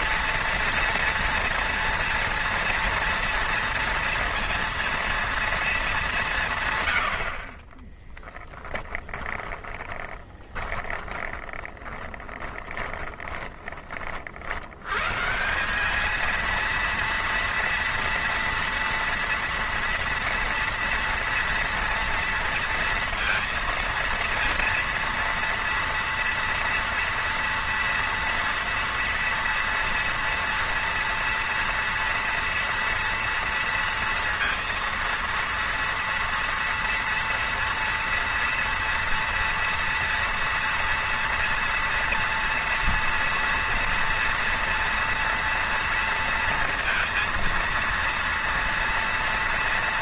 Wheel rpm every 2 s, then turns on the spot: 240, 230, 230, 140, 10, 20, 20, 80, 230, 230, 230, 230, 230, 230, 230, 230, 230, 230, 230, 230, 240, 230, 230, 230, 230.
8-14